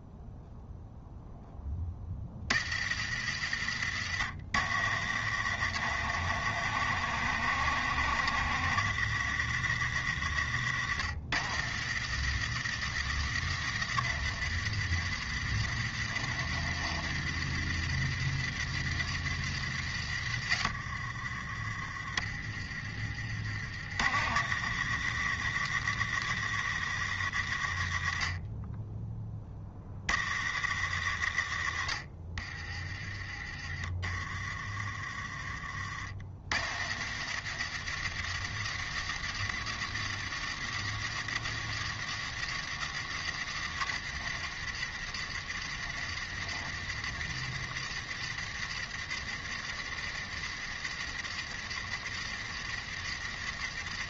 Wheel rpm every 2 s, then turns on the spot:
0, 50, 80, 90, 100, 80, 90, 70, 80, 70, 50, 40, 80, 80, 20, 70, 30, 30, 70, 80, 90, 90, 70, 70, 70, 70, 70.
none